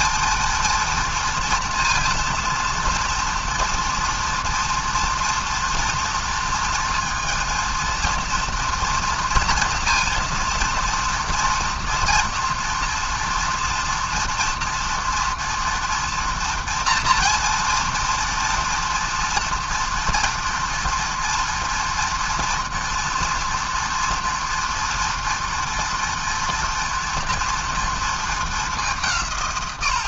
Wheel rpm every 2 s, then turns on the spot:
230, 230, 230, 230, 230, 230, 230, 230, 230, 230, 230, 230, 230, 230, 200.
none